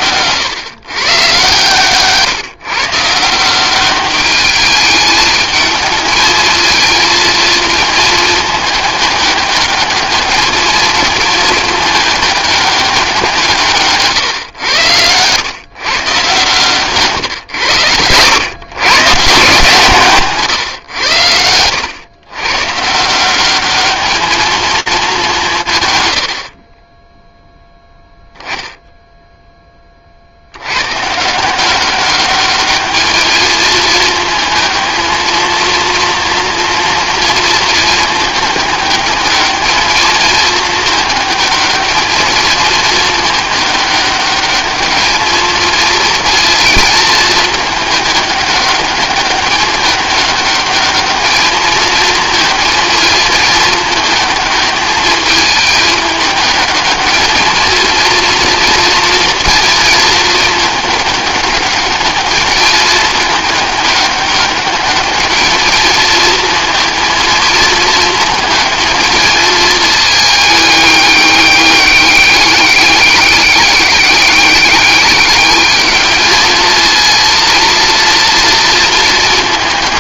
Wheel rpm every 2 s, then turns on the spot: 130, 150, 210, 220, 210, 220, 190, 110, 150, 120, 110, 160, 210, 10, 0, 120, 210, 220, 230, 210, 220, 220, 210, 220, 200, 210, 220, 220, 220, 230, 210, 210, 200, 230, 220, 210, 200, 200, 220, 220.
16-18 20-22